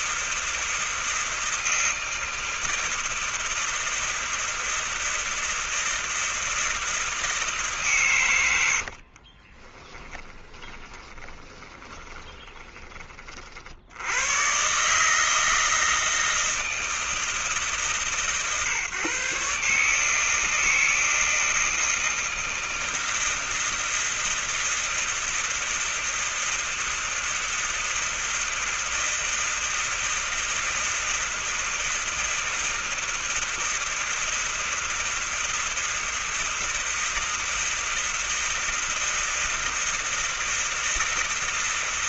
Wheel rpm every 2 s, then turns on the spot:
160, 160, 160, 160, 100, 20, 20, 110, 160, 140, 160, 160, 160, 160, 160, 160, 160, 160, 160, 160, 160.
8-14